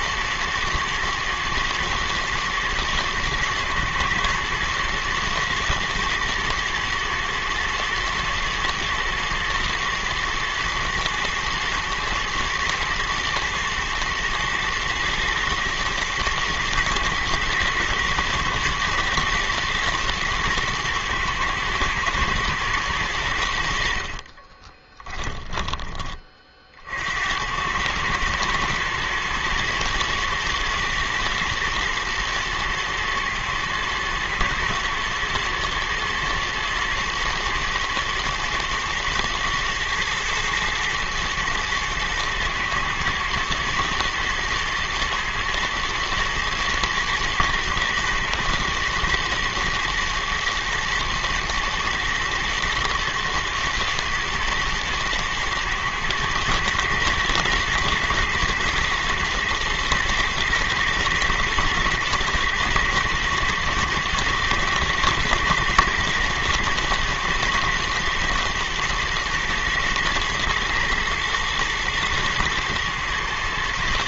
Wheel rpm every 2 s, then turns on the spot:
110, 120, 120, 120, 120, 110, 120, 110, 120, 120, 110, 110, 20, 50, 110, 110, 110, 110, 120, 110, 110, 110, 120, 110, 120, 120, 110, 110, 110, 120, 120, 120, 110, 110, 110, 110, 120.
24-26